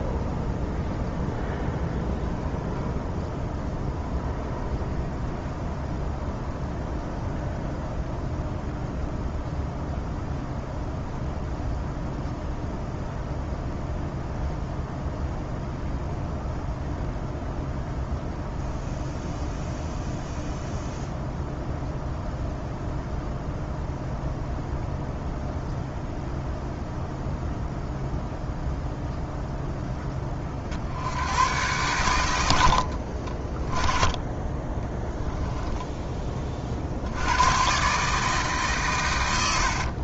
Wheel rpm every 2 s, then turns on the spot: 0, 0, 0, 0, 0, 0, 0, 0, 0, 0, 0, 0, 0, 0, 0, 70, 60, 10, 40, 130.
32-36